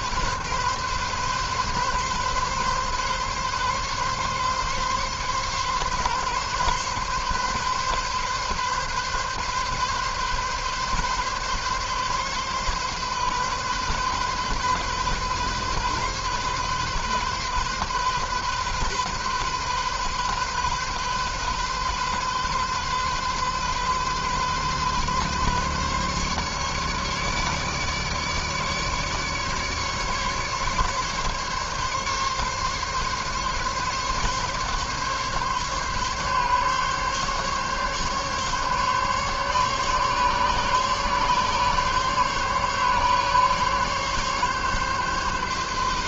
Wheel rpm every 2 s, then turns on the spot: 130, 130, 140, 130, 140, 140, 130, 130, 130, 130, 130, 130, 130, 140, 150, 140, 140, 140, 140, 140, 140, 140, 140.
none